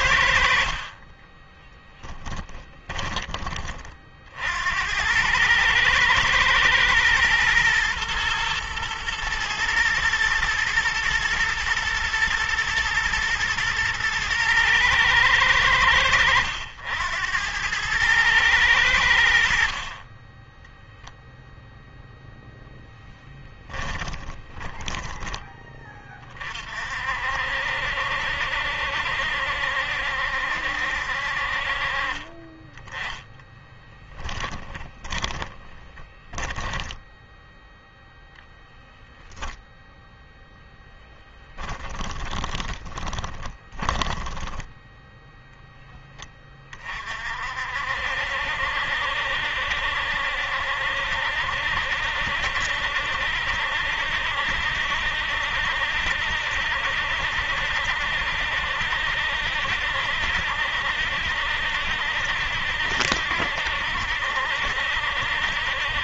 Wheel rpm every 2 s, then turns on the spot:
30, 30, 90, 110, 120, 110, 120, 110, 90, 70, 0, 0, 20, 50, 70, 60, 20, 20, 10, 0, 10, 20, 10, 40, 70, 70, 70, 70, 70, 70, 70, 70, 70.
32-38 40-44